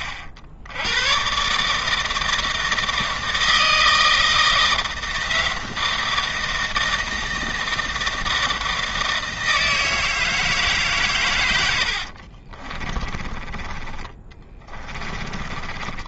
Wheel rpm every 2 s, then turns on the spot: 100, 160, 160, 160, 160, 150, 30, 20.
12-16